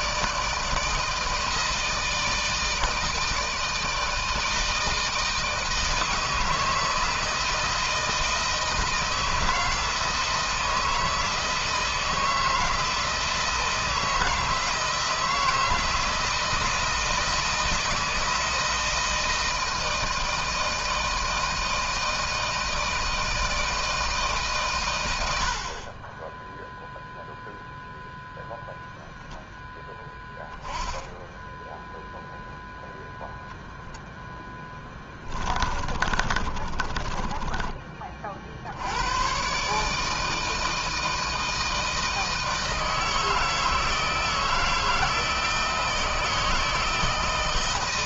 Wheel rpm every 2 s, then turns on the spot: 160, 160, 160, 160, 160, 160, 160, 160, 160, 160, 160, 160, 140, 10, 0, 10, 0, 10, 30, 50, 160, 160, 160, 160.
34-38